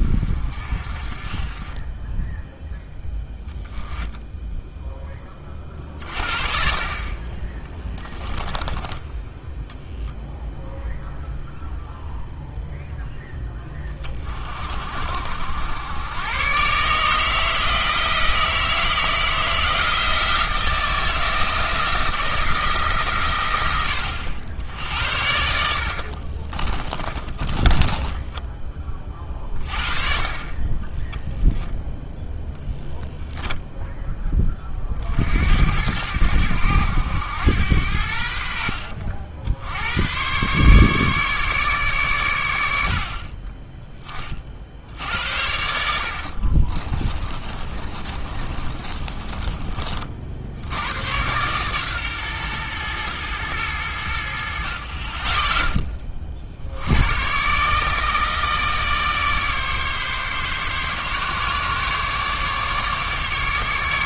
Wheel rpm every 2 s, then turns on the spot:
40, 10, 10, 40, 10, 0, 0, 60, 140, 160, 170, 140, 70, 30, 30, 20, 0, 40, 90, 60, 140, 70, 60, 30, 30, 90, 120, 40, 80, 150, 140, 140.
8-10 26-28 46-50